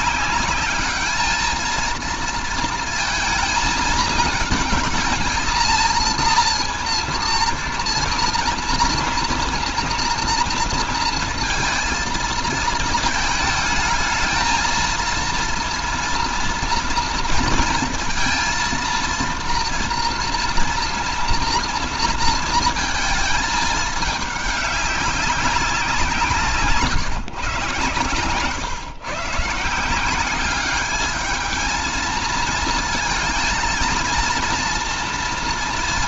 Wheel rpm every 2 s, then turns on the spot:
200, 230, 220, 230, 230, 230, 230, 220, 230, 230, 230, 230, 200, 150, 130, 200, 220, 240.
none